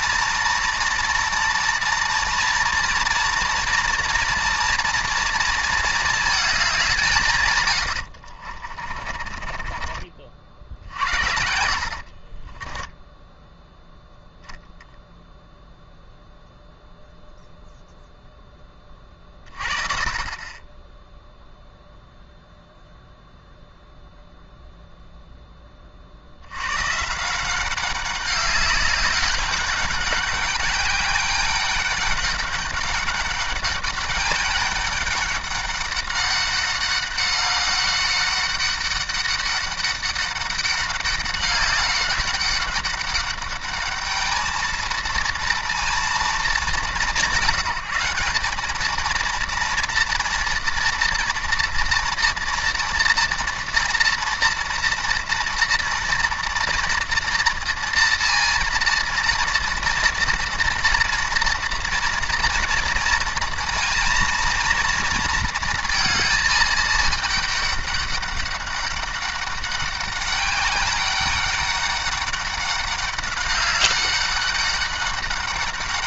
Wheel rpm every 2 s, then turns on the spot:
230, 230, 230, 200, 40, 70, 20, 0, 0, 20, 20, 0, 0, 110, 200, 200, 200, 200, 200, 200, 200, 200, 220, 190, 210, 230, 230, 230, 240, 230, 230, 230, 240, 220, 200, 200, 200, 200.
8-10 12-14